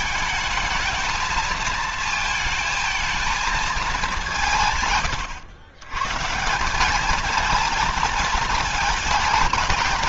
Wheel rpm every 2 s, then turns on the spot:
220, 220, 130, 200, 220.
none